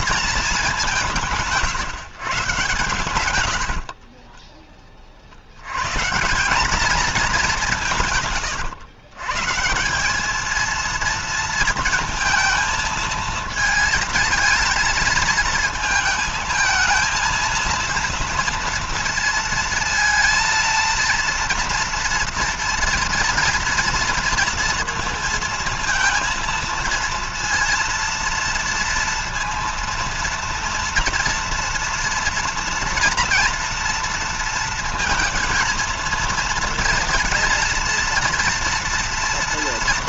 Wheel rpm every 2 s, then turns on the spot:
190, 120, 30, 210, 150, 230, 220, 220, 220, 230, 230, 230, 230, 230, 230, 230, 230, 230, 230, 230.
none